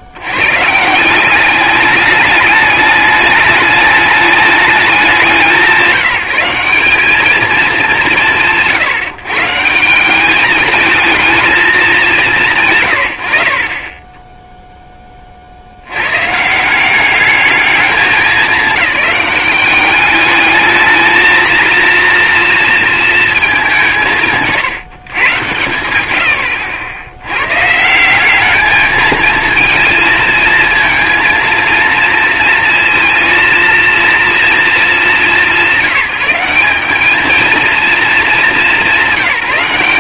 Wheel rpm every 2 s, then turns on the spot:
70, 210, 210, 180, 130, 200, 160, 0, 160, 200, 210, 230, 150, 80, 210, 230, 230, 210, 190, 200.
none